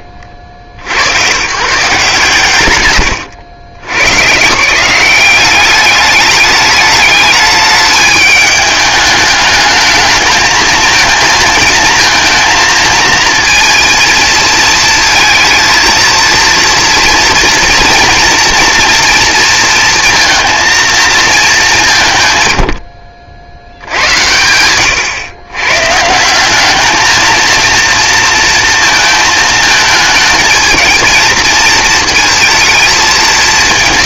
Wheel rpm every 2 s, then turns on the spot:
70, 130, 170, 210, 210, 220, 230, 230, 230, 240, 230, 70, 110, 220, 230, 220, 220.
none